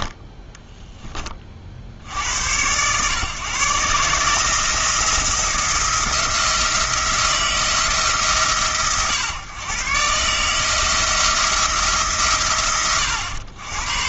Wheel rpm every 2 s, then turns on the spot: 10, 110, 160, 170, 120, 160, 80.
0-2